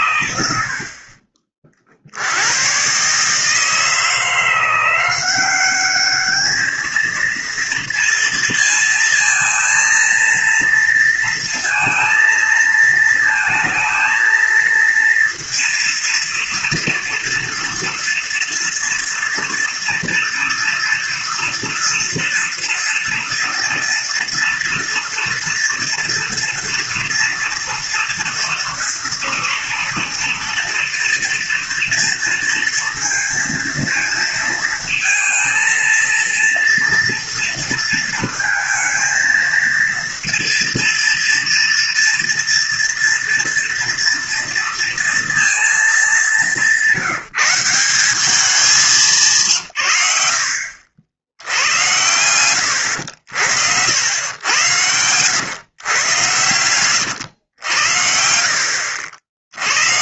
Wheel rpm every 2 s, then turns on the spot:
90, 90, 170, 210, 230, 230, 230, 230, 230, 230, 240, 230, 230, 230, 230, 230, 230, 230, 230, 220, 230, 230, 230, 190, 200, 60, 100, 100, 110, 70.
52-54 56-58